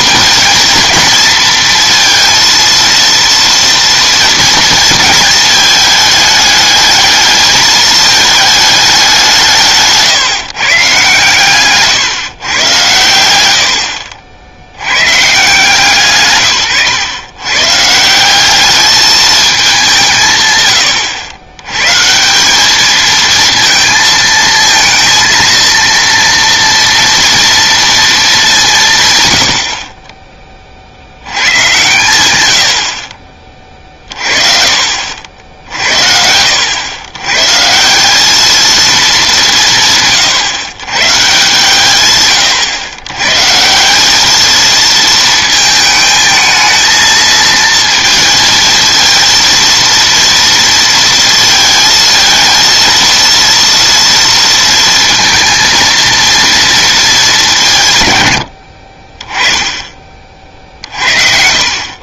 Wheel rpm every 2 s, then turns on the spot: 230, 230, 230, 210, 210, 140, 120, 80, 140, 200, 130, 210, 230, 230, 180, 40, 90, 50, 90, 220, 130, 110, 220, 220, 230, 230, 230, 230, 230, 60, 50.
none